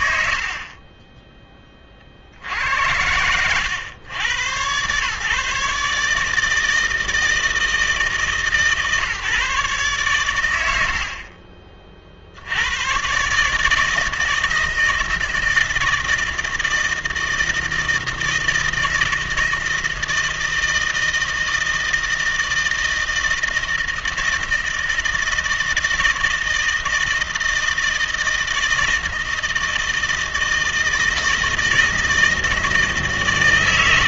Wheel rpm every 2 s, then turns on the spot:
70, 90, 100, 160, 140, 90, 90, 160, 160, 160, 160, 160, 160, 160, 160, 160, 160.
none